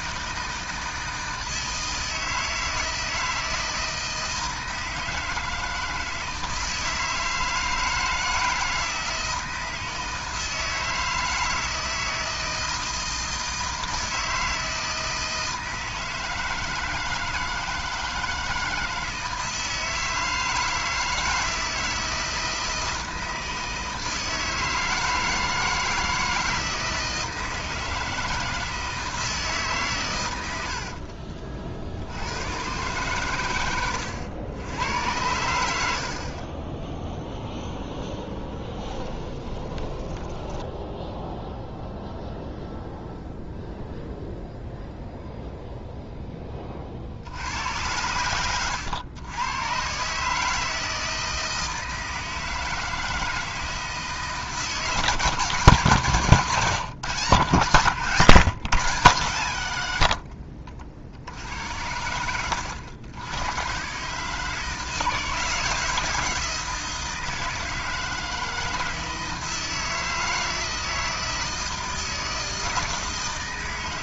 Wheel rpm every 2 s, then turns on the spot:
160, 160, 160, 160, 160, 160, 160, 160, 160, 160, 160, 160, 160, 160, 160, 70, 120, 100, 10, 20, 10, 0, 0, 30, 100, 160, 160, 150, 140, 140, 60, 90, 160, 160, 160, 160, 160.
30-32 38-42